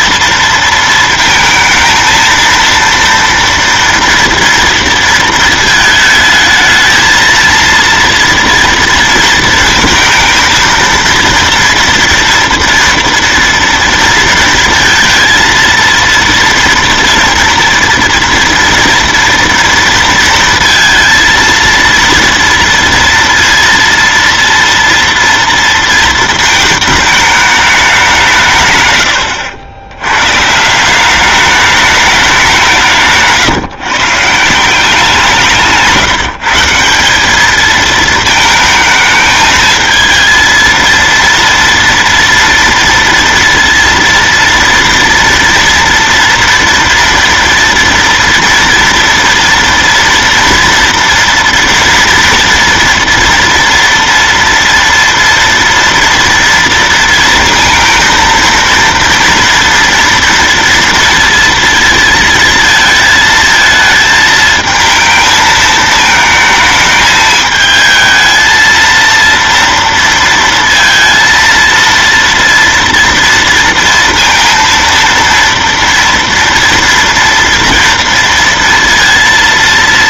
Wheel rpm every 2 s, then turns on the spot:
230, 230, 230, 220, 230, 230, 230, 230, 230, 230, 230, 240, 230, 220, 140, 140, 190, 170, 160, 220, 230, 230, 230, 240, 230, 230, 230, 230, 230, 230, 230, 230, 220, 220, 220, 230, 230, 230, 230, 230.
none